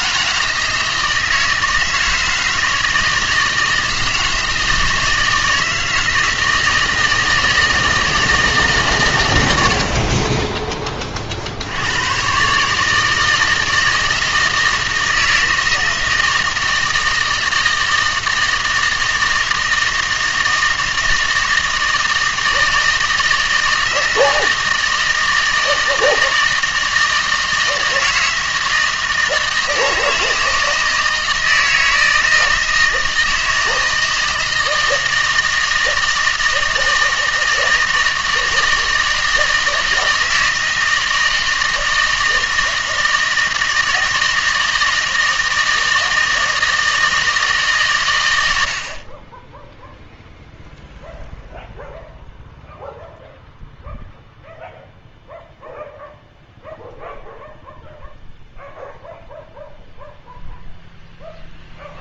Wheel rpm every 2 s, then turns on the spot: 160, 160, 160, 160, 150, 20, 150, 160, 160, 160, 160, 160, 160, 160, 160, 160, 160, 160, 160, 160, 160, 160, 160, 160, 70, 0, 0, 0, 0, 0, 0.
none